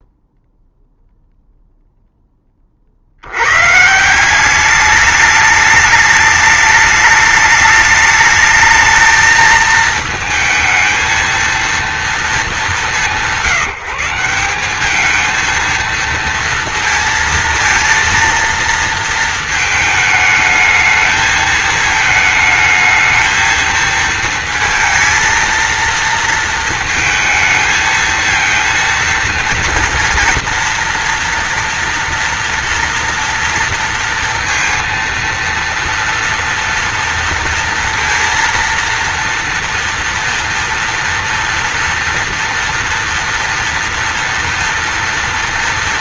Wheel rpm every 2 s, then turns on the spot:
0, 60, 200, 210, 220, 220, 170, 210, 230, 230, 220, 220, 230, 220, 230, 230, 240, 230, 230, 230, 230, 230, 230.
none